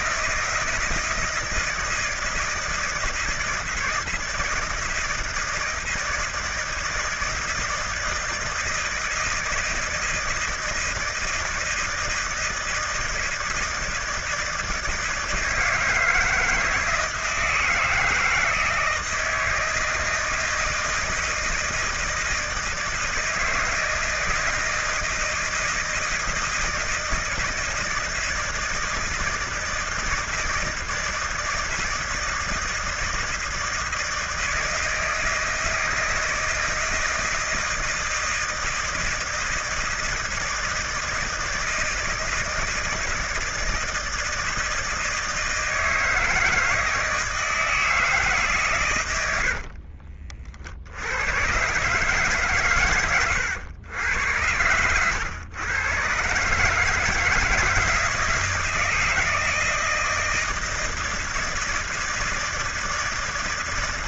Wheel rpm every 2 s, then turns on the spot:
160, 160, 170, 160, 160, 160, 160, 160, 160, 160, 160, 160, 160, 160, 160, 160, 160, 160, 160, 160, 160, 160, 160, 160, 130, 60, 130, 100, 150, 160, 160, 160.
none